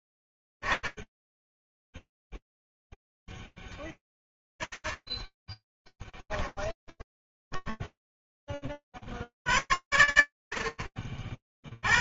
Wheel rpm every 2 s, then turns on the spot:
10, 0, 20, 10, 10, 50.
6-8